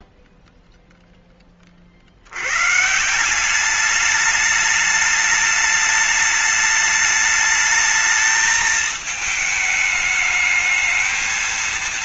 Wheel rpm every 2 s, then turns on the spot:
0, 90, 210, 210, 220, 210.
none